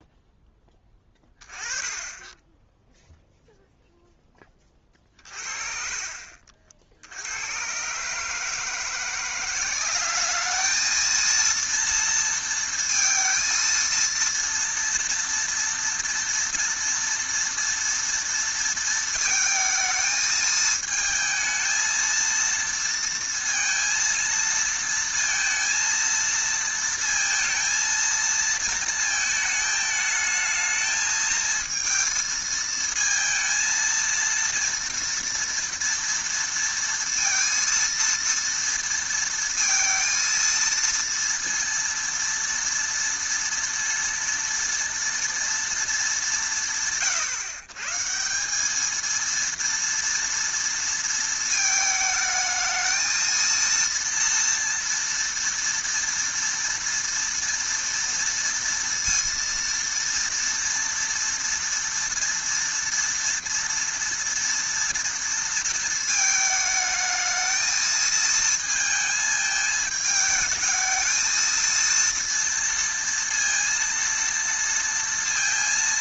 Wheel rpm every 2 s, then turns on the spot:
10, 0, 50, 70, 170, 220, 230, 240, 230, 220, 220, 230, 230, 230, 220, 220, 220, 230, 230, 230, 230, 230, 230, 150, 220, 230, 220, 230, 230, 230, 240, 230, 230, 220, 220, 220, 230, 230.
4-6